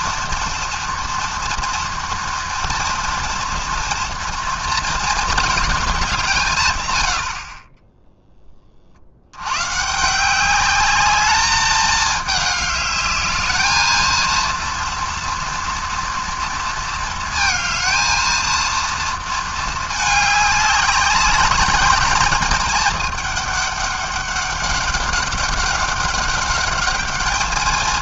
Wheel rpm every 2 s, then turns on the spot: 240, 230, 230, 140, 20, 190, 210, 230, 230, 230, 210, 220, 200, 200.
none